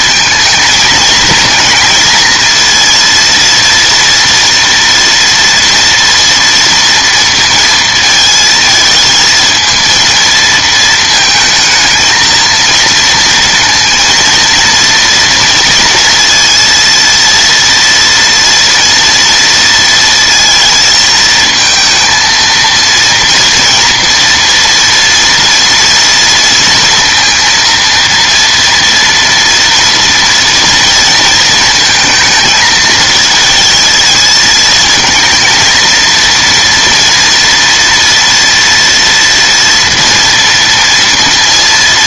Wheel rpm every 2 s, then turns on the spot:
220, 230, 230, 230, 220, 220, 230, 230, 230, 230, 220, 230, 230, 230, 230, 230, 220, 220, 230, 230, 230.
none